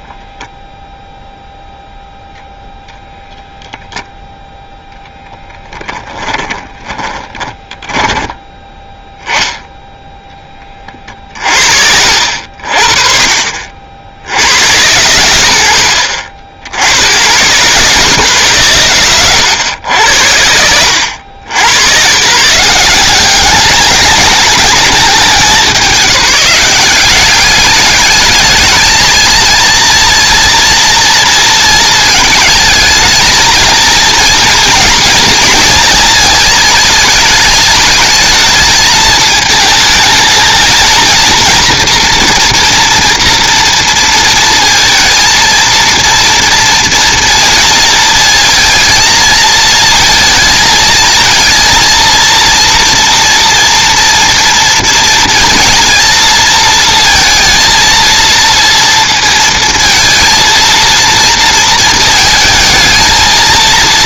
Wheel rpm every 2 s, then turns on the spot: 0, 0, 0, 10, 10, 30, 50, 110, 70, 120, 80, 170, 200, 190, 220, 230, 220, 230, 220, 220, 220, 230, 230, 230, 230, 220, 230, 230, 230, 230, 230, 220.
6-8